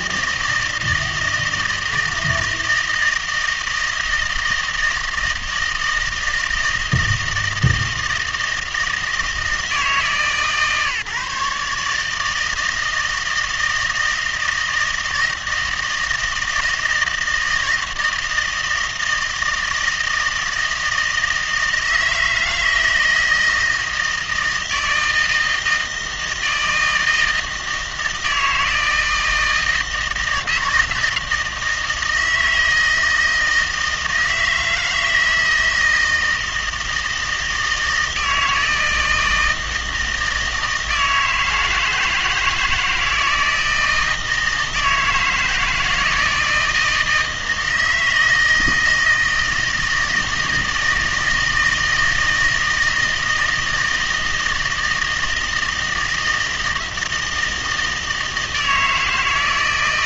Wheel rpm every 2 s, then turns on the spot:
160, 160, 160, 160, 160, 140, 160, 160, 160, 160, 160, 160, 160, 160, 160, 170, 160, 160, 160, 160, 160, 160, 160, 160, 160, 160, 160, 160, 160, 160.
none